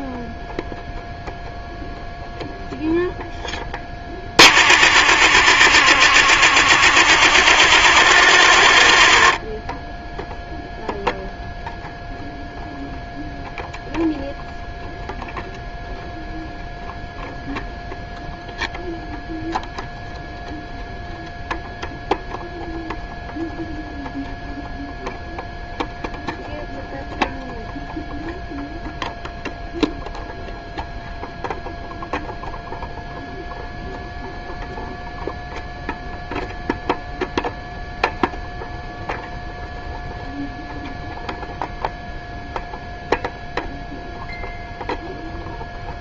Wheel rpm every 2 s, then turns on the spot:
0, 0, 30, 40, 30, 0, 0, 0, 0, 0, 0, 0, 0, 0, 0, 0, 0, 0, 0, 0, 0, 0, 0.
none